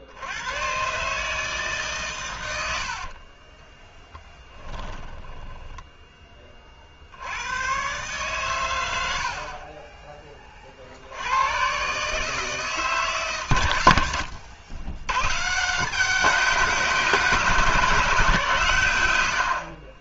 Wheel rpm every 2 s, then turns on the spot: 110, 90, 10, 30, 140, 40, 150, 90, 200, 160.
4-6